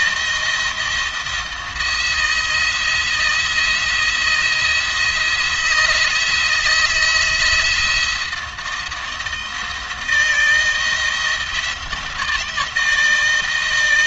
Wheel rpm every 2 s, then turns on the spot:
170, 170, 170, 170, 170, 160, 160.
none